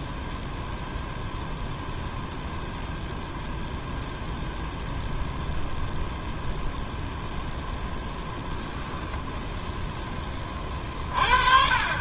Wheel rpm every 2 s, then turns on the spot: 0, 0, 0, 0, 10, 30.
none